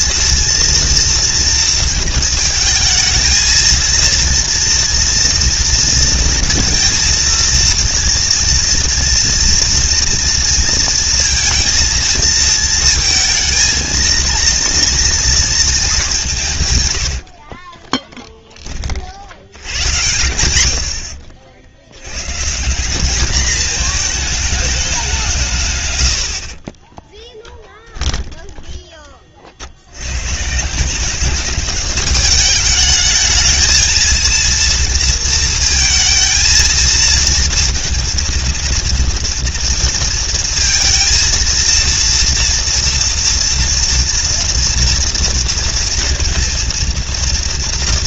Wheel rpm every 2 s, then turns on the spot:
230, 230, 240, 230, 230, 230, 220, 230, 120, 30, 100, 170, 210, 40, 10, 160, 210, 230, 220, 230, 230, 230, 230, 230.
16-18 20-22 26-28